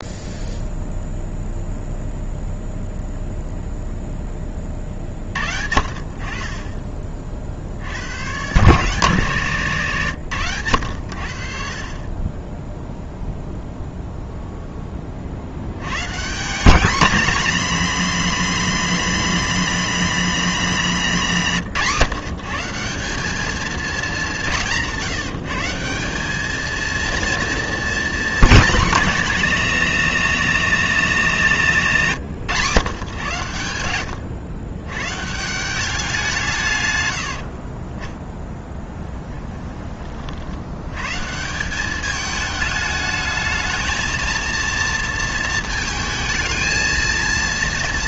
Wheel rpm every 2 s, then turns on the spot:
0, 0, 30, 30, 130, 90, 10, 0, 190, 220, 200, 160, 180, 220, 230, 210, 130, 120, 150, 10, 70, 210, 230, 230.
38-40